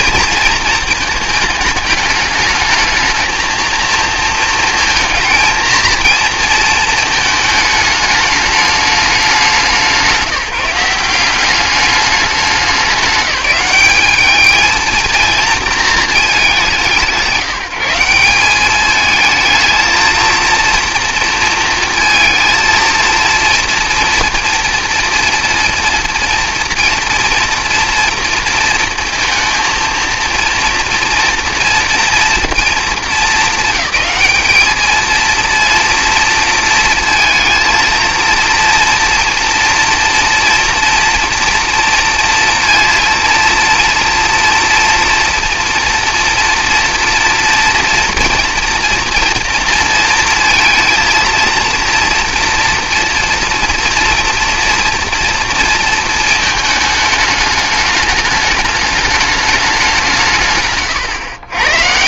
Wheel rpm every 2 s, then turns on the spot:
230, 210, 230, 230, 210, 180, 190, 220, 170, 200, 230, 230, 230, 240, 230, 230, 230, 220, 230, 230, 230, 230, 230, 230, 230, 230, 230, 230, 210, 210, 140.
none